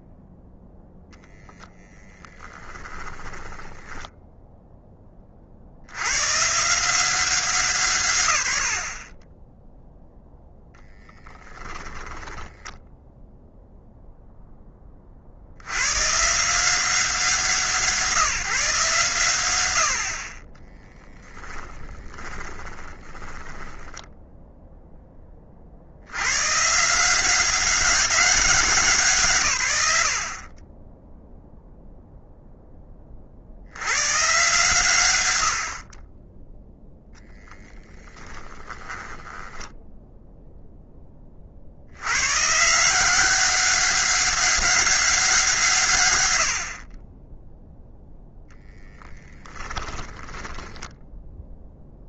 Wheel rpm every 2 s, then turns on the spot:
0, 20, 10, 150, 80, 0, 10, 10, 170, 150, 30, 20, 10, 130, 180, 30, 10, 120, 0, 30, 0, 150, 200, 60, 0, 10.
2-4 12-14 22-24 38-40 50-52